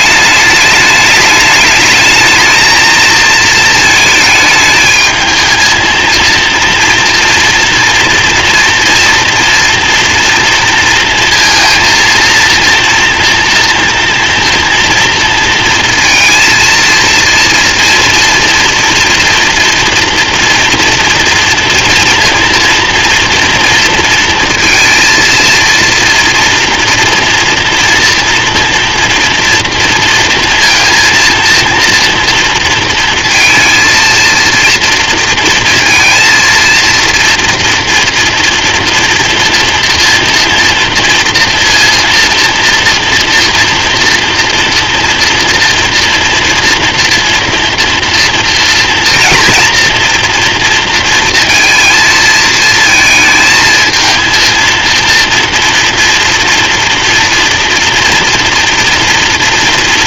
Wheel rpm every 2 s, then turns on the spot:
210, 220, 220, 230, 240, 230, 230, 230, 230, 230, 240, 240, 230, 240, 230, 230, 230, 230, 230, 230, 230, 230, 230, 230, 230, 230, 220, 230, 240, 230.
none